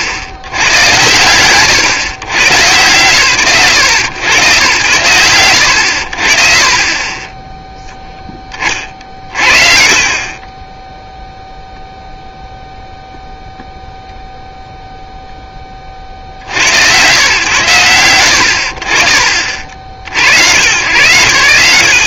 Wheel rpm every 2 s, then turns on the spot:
70, 110, 90, 40, 50, 10, 0, 0, 70, 60, 90.
none